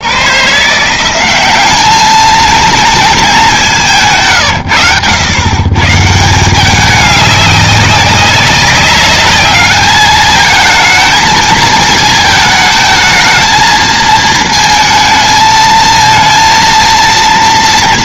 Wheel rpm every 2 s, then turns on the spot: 160, 230, 110, 200, 200, 220, 220, 220, 230.
none